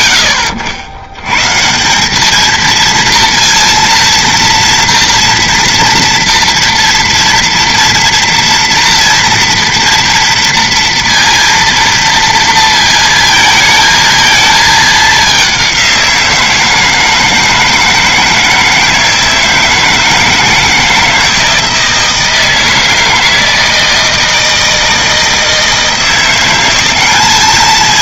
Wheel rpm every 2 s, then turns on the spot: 80, 220, 230, 230, 230, 230, 230, 220, 160, 160, 160, 160, 160, 190.
none